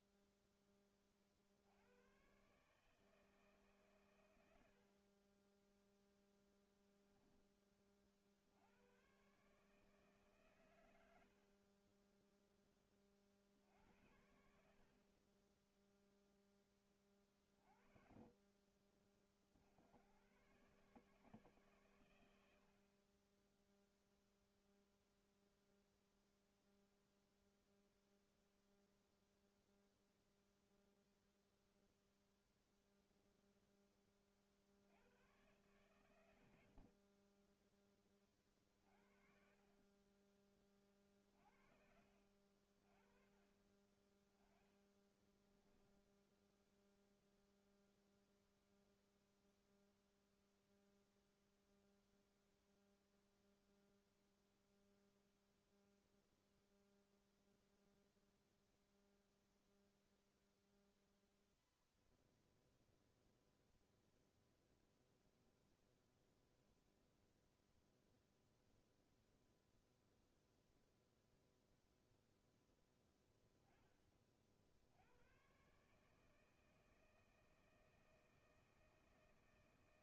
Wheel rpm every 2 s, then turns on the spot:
0, 140, 90, 0, 80, 140, 10, 50, 10, 30, 130, 80, 0, 0, 0, 0, 0, 50, 90, 40, 20, 60, 20, 0, 0, 0, 0, 0, 0, 0, 0, 0, 0, 0, 0, 0, 0, 50, 160, 160.
38-40 44-46